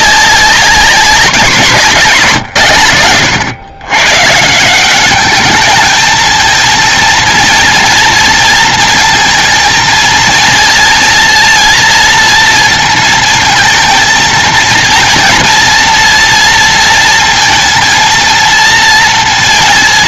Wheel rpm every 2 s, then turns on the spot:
190, 140, 130, 220, 230, 230, 230, 230, 230, 230.
none